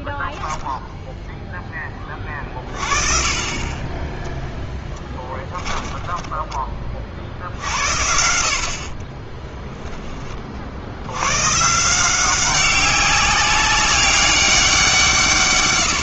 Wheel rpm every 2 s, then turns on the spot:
0, 30, 0, 30, 60, 60, 190, 190.
8-10